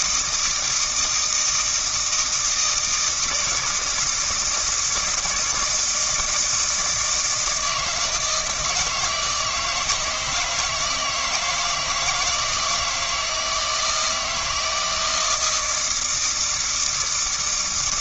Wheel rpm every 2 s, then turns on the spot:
160, 160, 160, 160, 160, 160, 170, 160, 160.
none